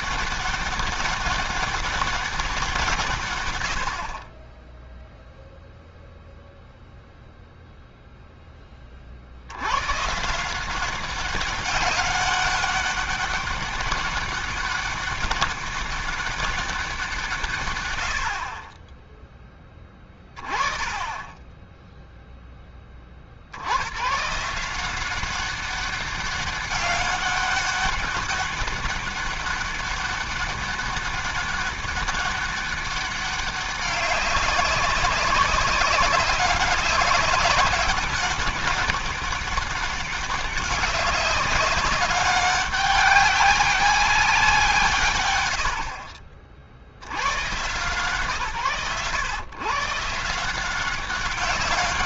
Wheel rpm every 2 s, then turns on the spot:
200, 190, 30, 0, 10, 160, 200, 200, 200, 50, 20, 0, 140, 200, 200, 200, 200, 190, 190, 200, 190, 200, 190, 70, 140, 170.
none